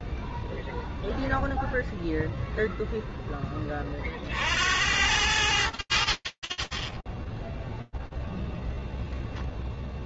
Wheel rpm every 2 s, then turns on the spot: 0, 0, 40, 40, 0.
none